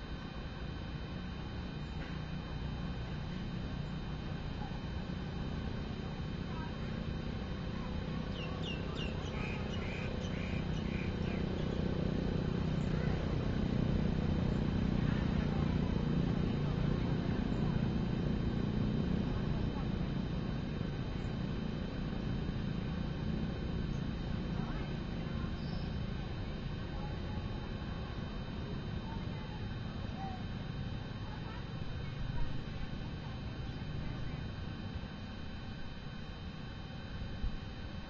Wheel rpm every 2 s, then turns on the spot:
0, 0, 0, 0, 0, 0, 0, 0, 0, 0, 0, 0, 0, 0, 0, 0, 0, 0, 0.
none